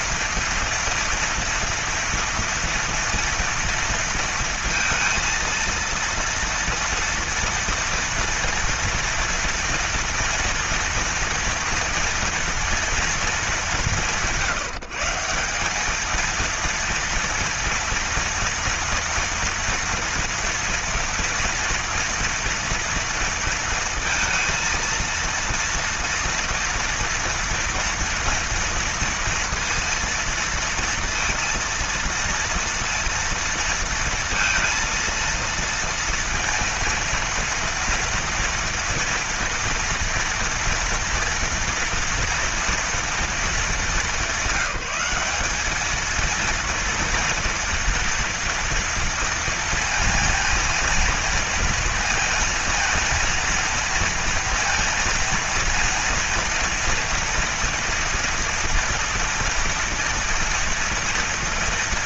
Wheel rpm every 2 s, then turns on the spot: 230, 230, 230, 230, 230, 230, 230, 170, 230, 230, 230, 240, 230, 240, 230, 230, 230, 230, 230, 230, 230, 230, 190, 230, 230, 230, 230, 230, 230, 230, 230.
none